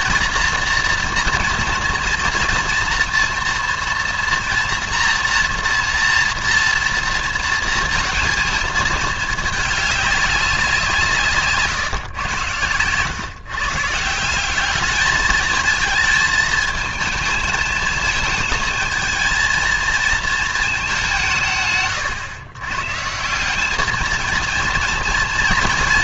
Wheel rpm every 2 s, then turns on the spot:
230, 230, 230, 230, 220, 190, 120, 190, 220, 220, 210, 130, 230.
none